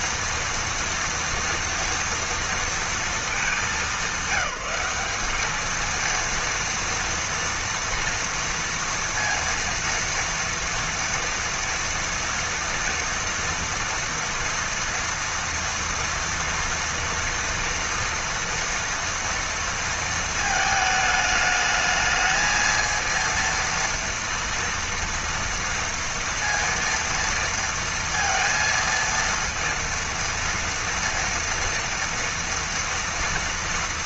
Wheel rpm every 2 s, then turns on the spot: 230, 230, 190, 230, 230, 230, 230, 230, 230, 230, 230, 220, 230, 230, 230, 230, 230.
none